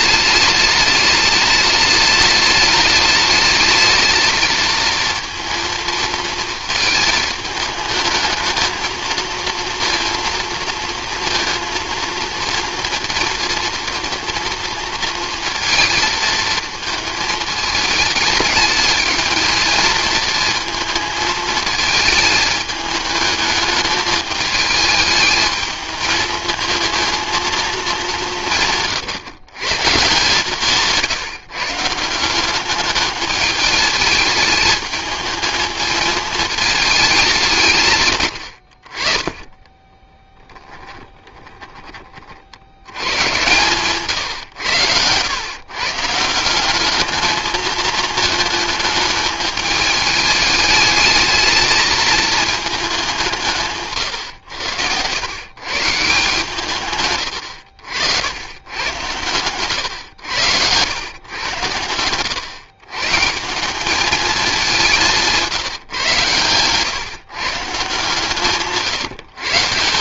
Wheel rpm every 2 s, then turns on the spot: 210, 210, 220, 220, 220, 230, 230, 230, 220, 210, 220, 210, 210, 230, 150, 160, 200, 210, 220, 70, 10, 80, 110, 190, 220, 210, 220, 100, 140, 100, 100, 120, 200, 120, 150.
40-42 68-70